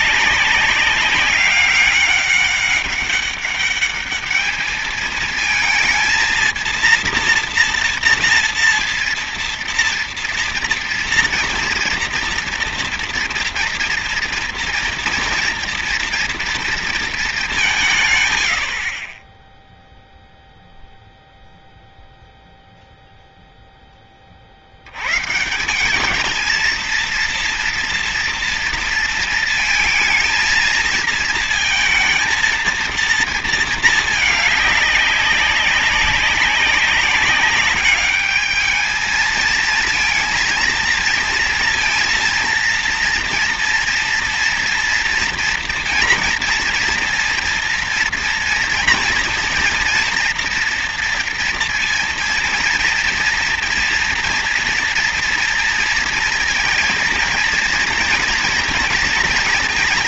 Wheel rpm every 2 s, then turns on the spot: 190, 190, 210, 230, 230, 240, 230, 230, 230, 90, 0, 0, 50, 220, 230, 230, 230, 210, 200, 210, 230, 230, 230, 230, 230, 240, 230, 230, 230, 230.
none